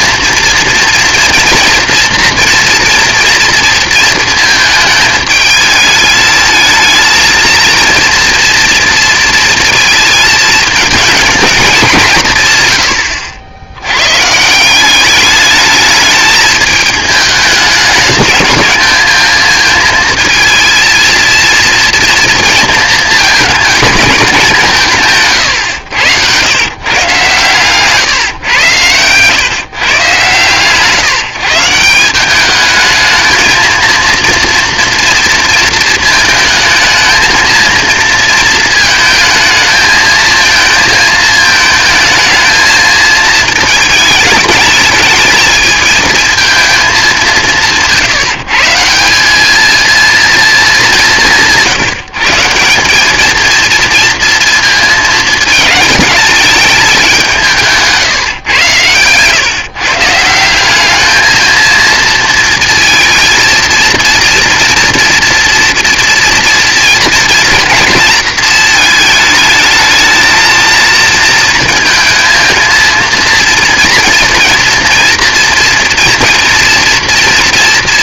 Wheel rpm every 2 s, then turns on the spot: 230, 230, 220, 220, 230, 230, 120, 180, 210, 220, 230, 230, 180, 130, 110, 150, 210, 230, 220, 230, 230, 220, 220, 220, 160, 220, 180, 230, 200, 120, 190, 230, 230, 230, 220, 230, 230, 230, 230.
none